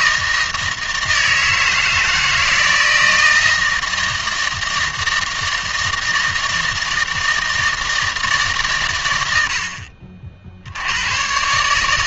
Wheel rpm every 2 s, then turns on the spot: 160, 160, 160, 160, 120, 80.
none